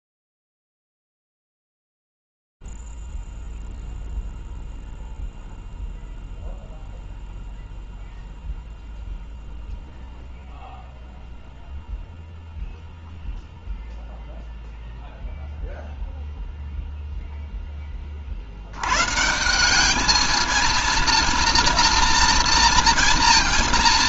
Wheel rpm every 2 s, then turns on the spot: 0, 0, 0, 0, 0, 0, 0, 0, 0, 90, 220, 230.
none